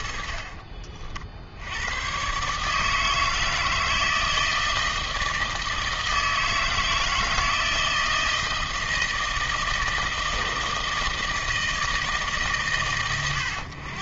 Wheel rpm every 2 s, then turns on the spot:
50, 140, 160, 160, 160, 160, 120.
0-2